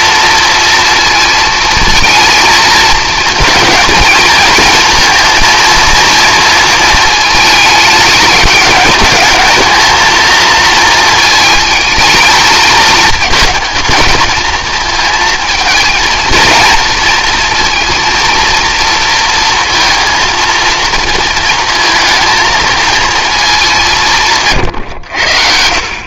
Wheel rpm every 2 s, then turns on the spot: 230, 230, 230, 220, 210, 230, 220, 220, 230, 230, 230, 230, 130.
none